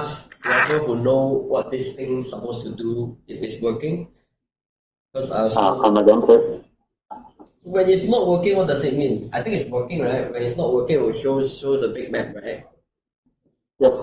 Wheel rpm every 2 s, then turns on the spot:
0, 0, 0, 0, 0, 0, 0.
none